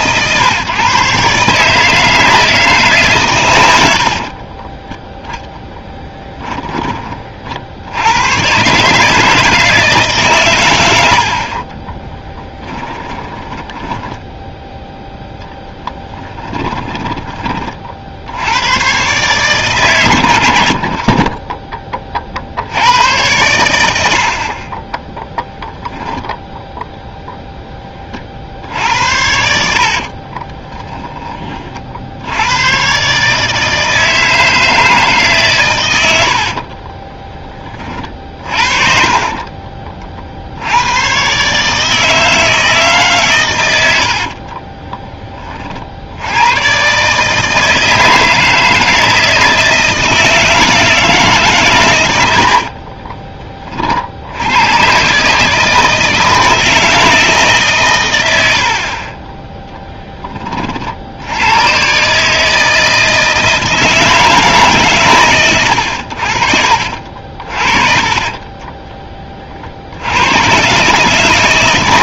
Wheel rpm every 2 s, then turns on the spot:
130, 160, 20, 10, 140, 110, 20, 0, 10, 100, 70, 70, 30, 0, 60, 20, 100, 160, 40, 50, 80, 160, 30, 120, 160, 160, 60, 100, 160, 70, 30, 160, 140, 50, 20, 130.
4-6 12-14 16-18 30-32 36-38 44-46 52-54 66-70